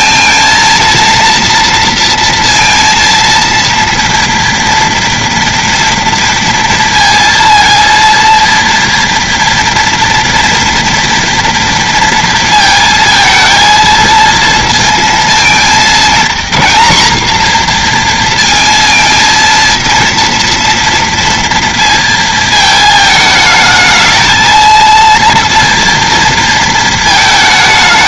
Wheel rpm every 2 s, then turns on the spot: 230, 230, 230, 230, 230, 230, 230, 230, 240, 230, 230, 220, 230, 230.
none